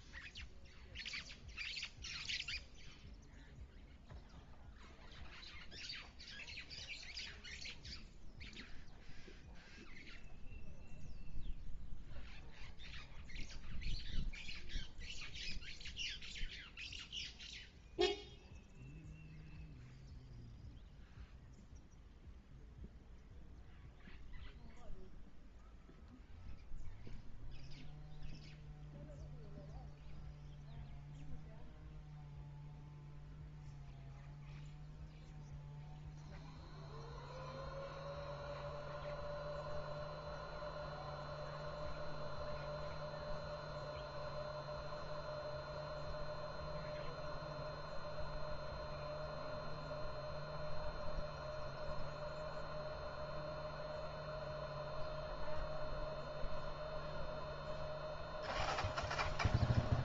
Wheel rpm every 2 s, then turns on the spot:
0, 0, 0, 0, 0, 0, 0, 0, 0, 0, 0, 0, 0, 0, 0, 0, 0, 0, 0, 0, 0, 0, 0, 0, 0, 0, 0, 0, 0, 0.
none